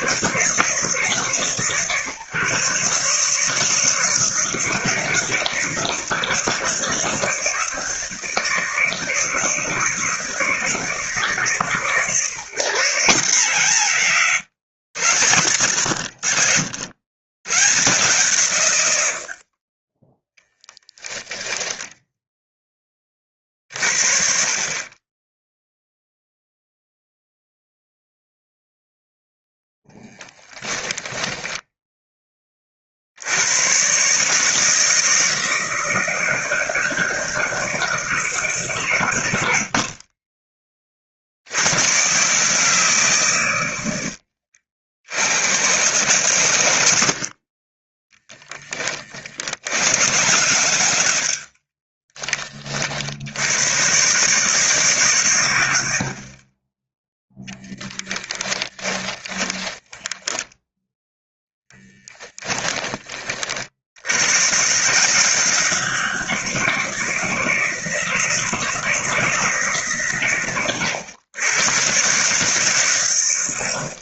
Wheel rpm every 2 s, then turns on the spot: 150, 140, 160, 160, 160, 150, 150, 100, 70, 90, 10, 20, 30, 0, 0, 10, 50, 160, 160, 120, 40, 150, 70, 90, 20, 90, 60, 130, 10, 10, 0, 20, 150, 160, 170, 120, 120.
30-32 58-60